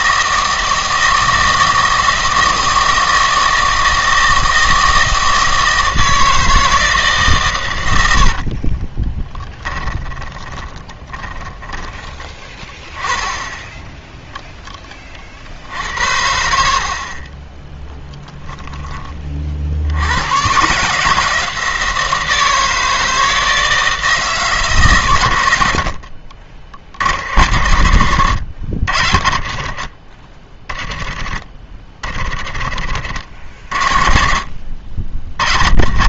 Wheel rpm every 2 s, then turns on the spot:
160, 160, 160, 160, 40, 20, 10, 10, 60, 10, 140, 160, 150, 70, 90, 20, 40, 60.
8-12 32-34